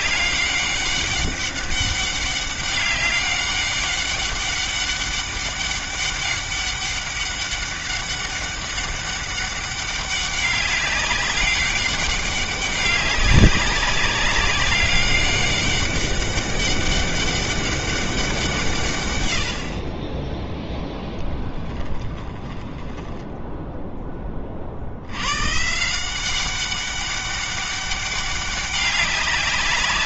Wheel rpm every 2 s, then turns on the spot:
200, 200, 200, 200, 200, 200, 200, 200, 200, 150, 10, 20, 60, 200, 200.
20-24